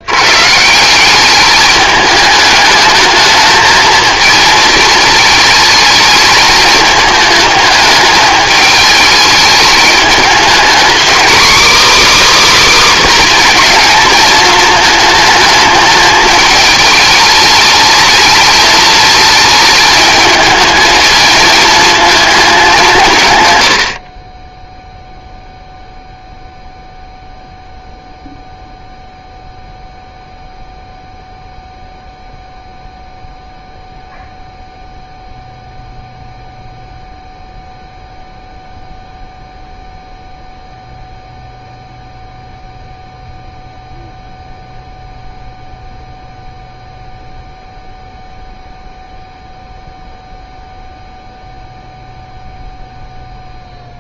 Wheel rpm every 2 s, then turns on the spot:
150, 210, 220, 210, 210, 230, 290, 220, 210, 220, 220, 200, 10, 0, 0, 0, 0, 0, 0, 0, 0, 0, 0, 0, 0, 0, 0.
none